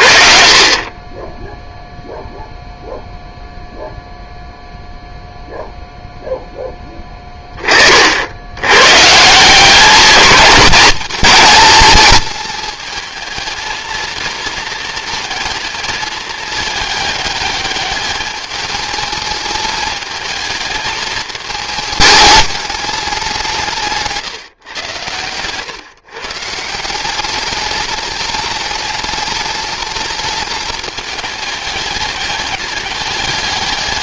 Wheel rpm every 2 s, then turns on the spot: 30, 0, 0, 10, 120, 210, 220, 230, 210, 220, 220, 200, 120, 170, 210, 210, 200.
none